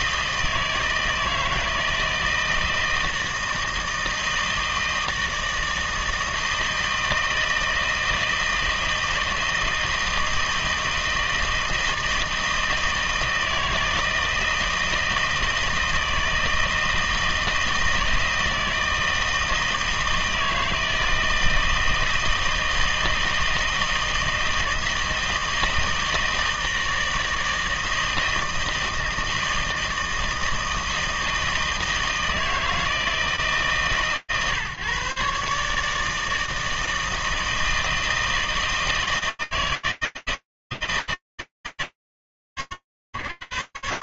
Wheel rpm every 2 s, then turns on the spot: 160, 160, 160, 160, 160, 160, 160, 160, 160, 160, 160, 160, 160, 160, 160, 160, 160, 140, 160, 160, 160, 100.
none